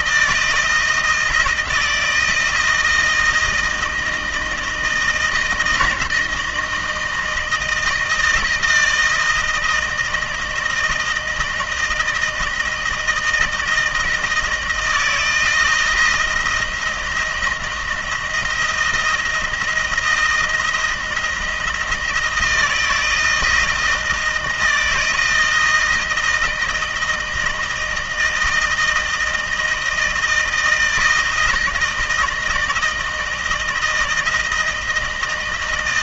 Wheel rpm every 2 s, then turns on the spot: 160, 160, 160, 160, 160, 160, 160, 160, 160, 170, 160, 160, 170, 160, 160, 160, 160, 160.
none